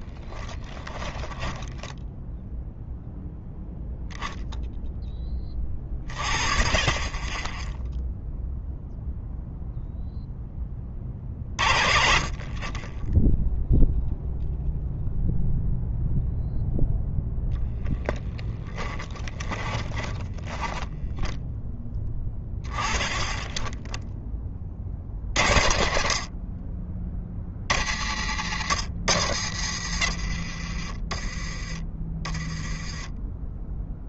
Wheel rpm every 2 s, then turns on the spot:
10, 0, 0, 30, 0, 20, 30, 0, 0, 10, 20, 10, 30, 30, 70, 40, 20.
0-2 18-22